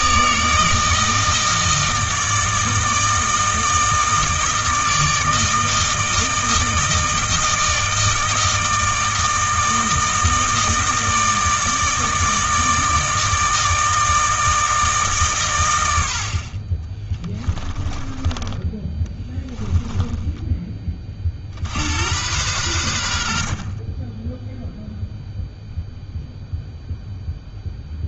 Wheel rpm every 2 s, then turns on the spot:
160, 160, 160, 160, 160, 160, 160, 160, 30, 20, 30, 90, 0, 0.
16-20